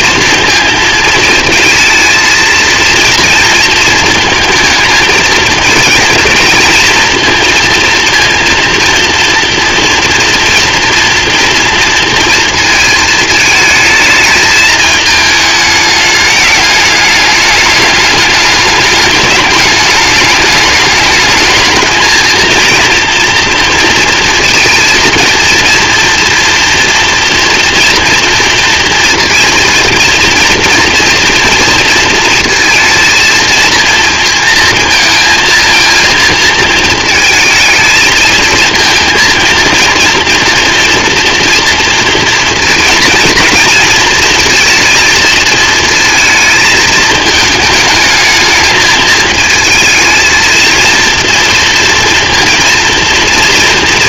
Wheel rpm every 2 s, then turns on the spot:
220, 230, 220, 220, 230, 230, 220, 220, 210, 210, 220, 230, 230, 230, 230, 230, 230, 230, 220, 230, 230, 230, 230, 220, 220, 230, 230.
none